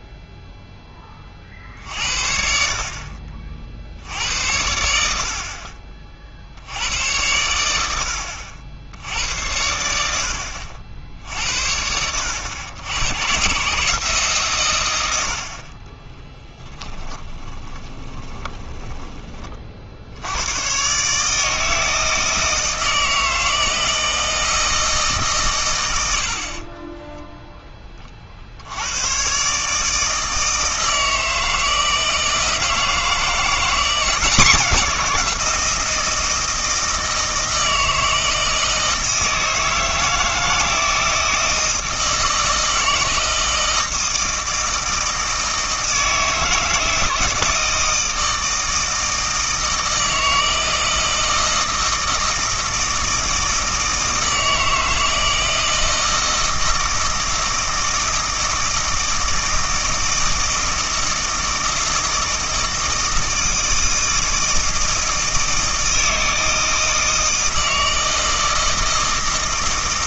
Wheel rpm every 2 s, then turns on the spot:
10, 60, 80, 80, 80, 70, 100, 120, 10, 10, 120, 160, 160, 30, 80, 160, 160, 180, 160, 160, 160, 160, 160, 160, 160, 160, 160, 160, 160, 160, 160, 160, 160, 160, 160.
16-20 26-28